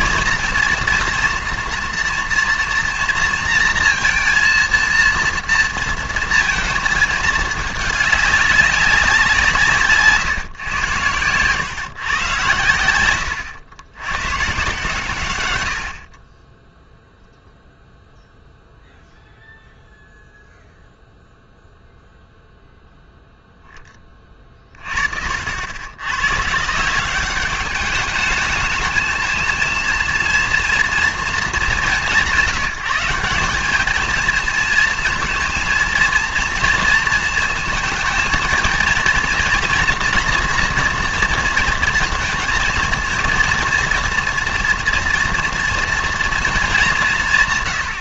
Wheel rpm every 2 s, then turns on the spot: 240, 230, 230, 230, 200, 120, 110, 130, 10, 0, 0, 0, 40, 150, 220, 230, 180, 230, 230, 220, 240, 230, 230, 220.
none